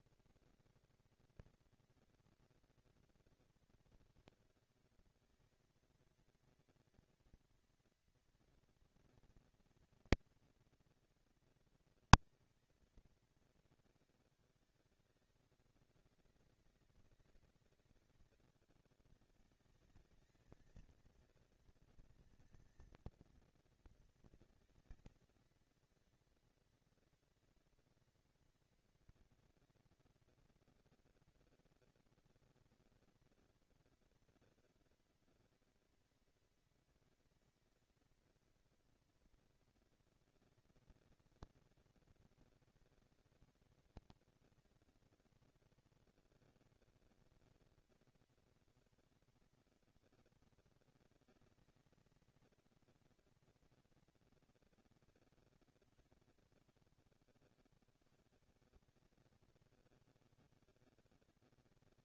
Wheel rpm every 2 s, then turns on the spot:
230, 230, 230, 230, 230, 230, 230, 210, 190, 200, 220, 230, 230, 230, 230, 230, 230, 230, 230, 230, 230, 230, 230, 230, 230, 230, 230, 230, 150, 140, 160.
none